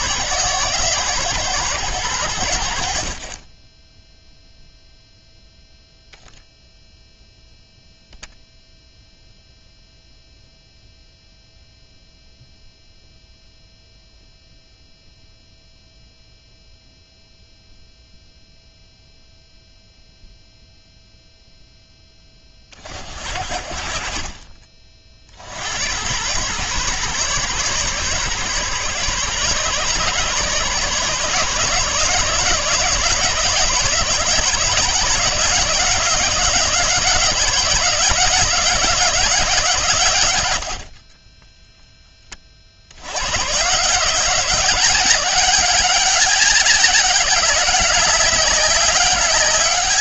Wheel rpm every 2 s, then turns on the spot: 120, 60, 0, 0, 0, 0, 0, 0, 0, 0, 0, 40, 40, 120, 130, 140, 160, 160, 170, 180, 40, 90, 190, 190, 190.
none